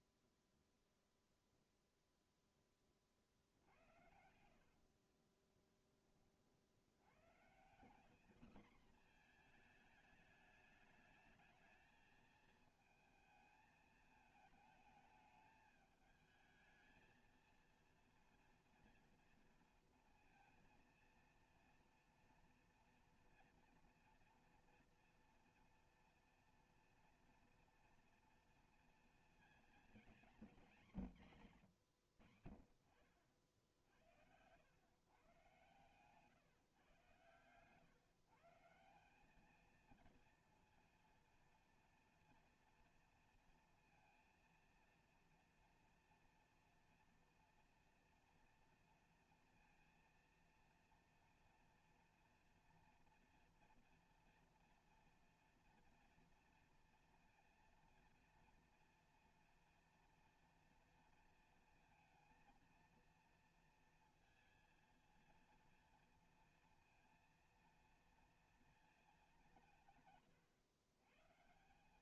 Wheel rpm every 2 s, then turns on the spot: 0, 10, 70, 50, 230, 210, 220, 220, 220, 230, 230, 230, 230, 240, 240, 230, 60, 110, 130, 160, 230, 230, 230, 230, 240, 230, 230, 230, 230, 230, 230, 230, 230, 230, 230, 120.
4-6